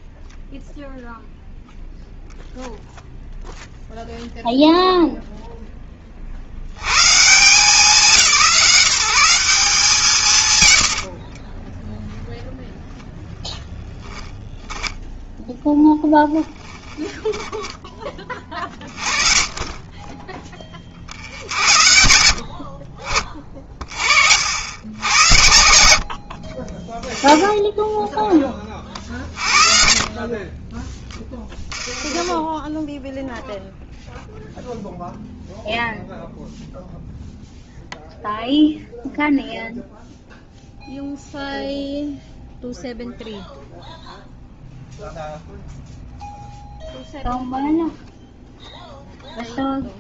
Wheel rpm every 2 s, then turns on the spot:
0, 0, 0, 120, 180, 70, 0, 10, 20, 20, 70, 40, 70, 0, 40, 20, 0, 0, 0, 0, 0, 0, 0, 0, 0.
10-12 16-18 24-26 30-32